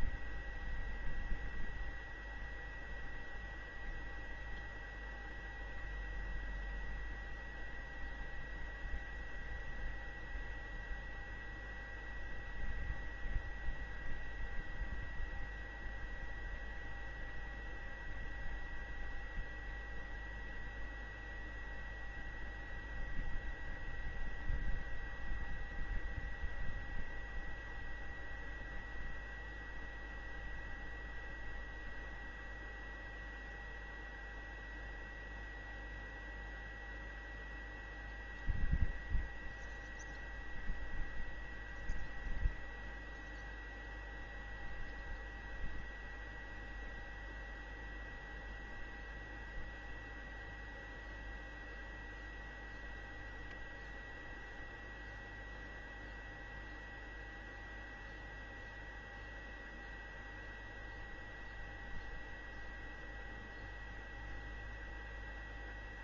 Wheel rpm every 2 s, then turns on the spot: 0, 0, 0, 0, 0, 0, 0, 0, 0, 0, 0, 0, 0, 0, 0, 0, 0, 0, 0, 0, 0, 0, 0, 0, 0, 0, 0, 0, 0, 0, 0, 0, 0.
none